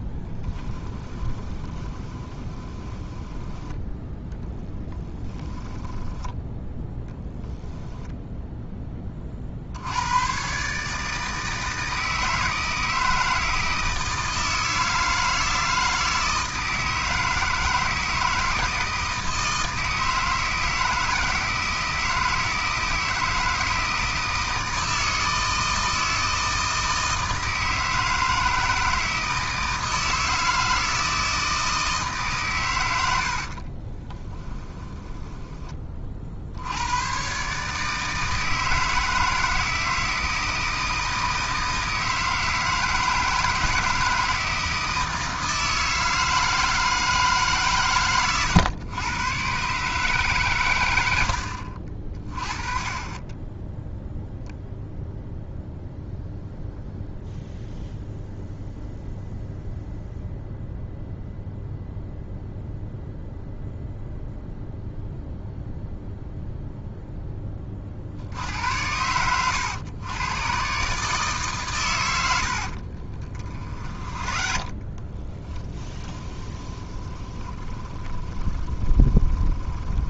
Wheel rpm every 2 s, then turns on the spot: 10, 20, 10, 10, 20, 150, 160, 160, 160, 160, 160, 160, 160, 160, 160, 160, 100, 20, 90, 160, 160, 160, 160, 160, 110, 100, 30, 0, 0, 0, 0, 0, 0, 0, 90, 140, 50, 20, 20, 20.
0-6 34-36 72-80